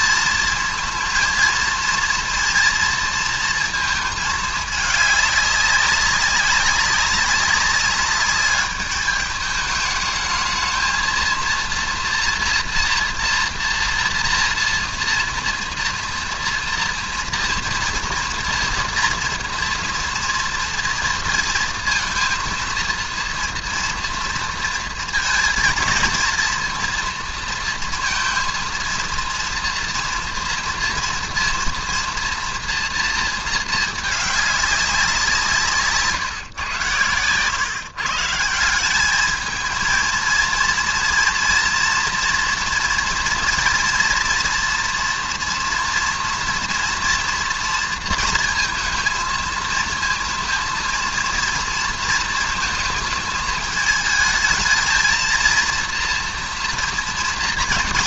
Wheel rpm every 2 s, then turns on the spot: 230, 230, 210, 200, 210, 220, 240, 240, 230, 230, 230, 230, 230, 230, 230, 230, 230, 200, 120, 180, 230, 230, 240, 230, 230, 220, 220, 220, 240.
none